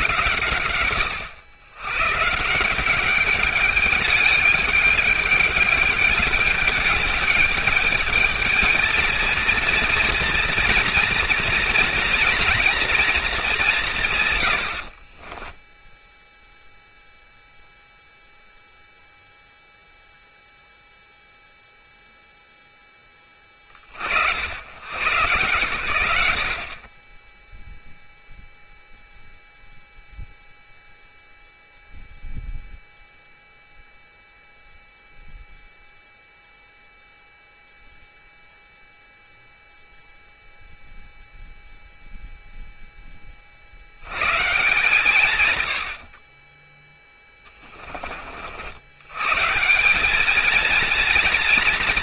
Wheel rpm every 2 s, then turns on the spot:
100, 200, 210, 220, 230, 240, 170, 0, 0, 0, 0, 30, 130, 0, 0, 0, 0, 0, 0, 0, 0, 50, 110, 20, 140, 230.
46-48